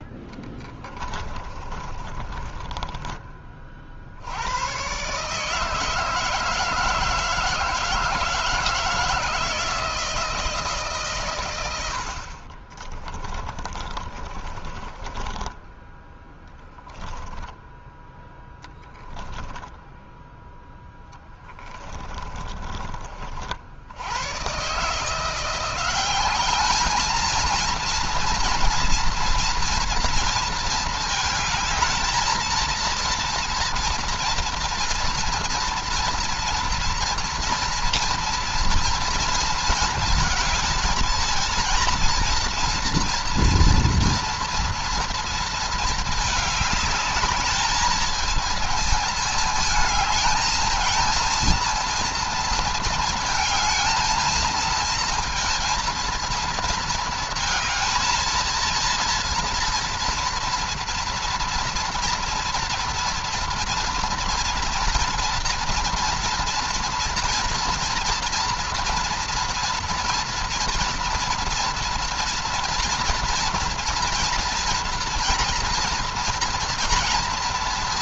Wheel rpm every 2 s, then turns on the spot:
20, 20, 130, 160, 160, 140, 30, 20, 10, 10, 10, 40, 150, 220, 230, 220, 230, 230, 230, 230, 220, 230, 230, 210, 220, 230, 230, 230, 220, 230, 230, 230, 230, 230, 240, 230, 230, 240, 230.
0-4 12-22